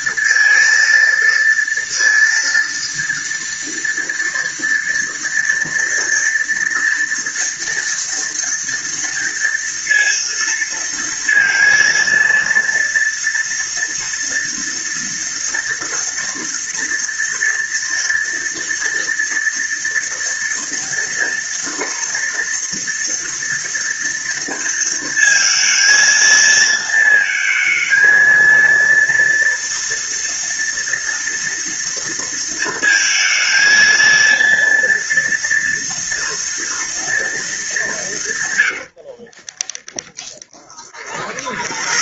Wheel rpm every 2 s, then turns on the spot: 230, 230, 230, 230, 230, 230, 230, 230, 230, 230, 230, 230, 230, 220, 230, 230, 230, 230, 230, 70, 30.
38-42